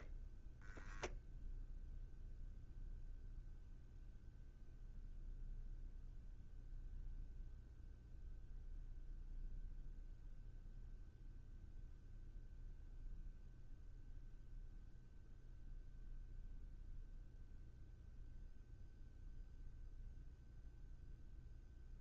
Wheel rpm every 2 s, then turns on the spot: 0, 0, 0, 0, 0, 0, 0, 0, 0, 0, 0.
none